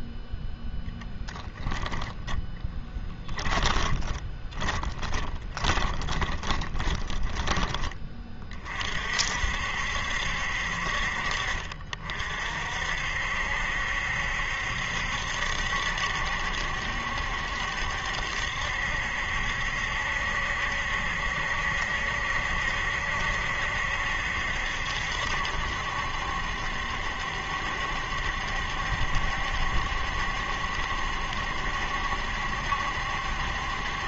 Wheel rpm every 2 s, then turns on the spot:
0, 10, 20, 10, 40, 50, 50, 70, 70, 70, 70, 70, 70, 70, 70, 70, 70.
2-8